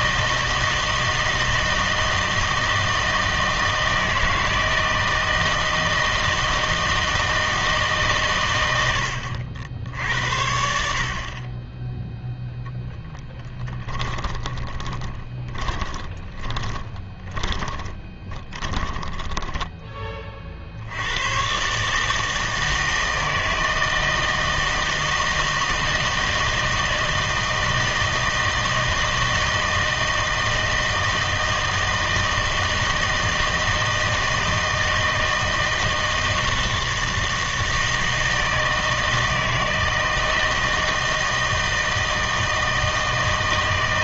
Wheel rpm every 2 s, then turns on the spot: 160, 160, 160, 160, 90, 70, 0, 20, 20, 20, 60, 160, 160, 160, 160, 160, 160, 160, 160, 160, 160, 160.
14-20